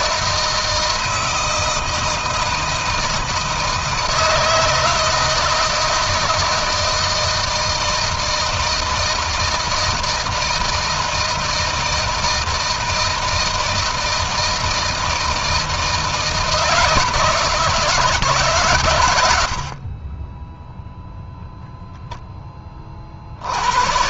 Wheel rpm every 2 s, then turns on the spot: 160, 160, 160, 160, 160, 160, 170, 160, 160, 110, 0, 30.
none